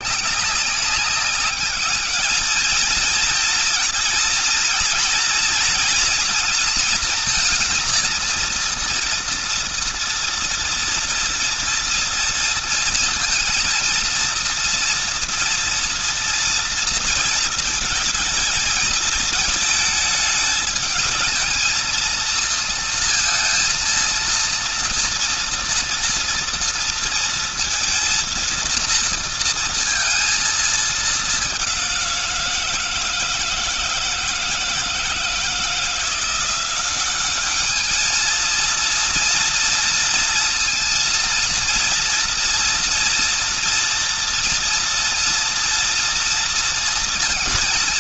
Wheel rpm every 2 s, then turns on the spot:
200, 230, 230, 220, 240, 230, 230, 230, 230, 220, 220, 230, 230, 230, 230, 210, 160, 160, 200, 230, 230, 230, 230, 230.
none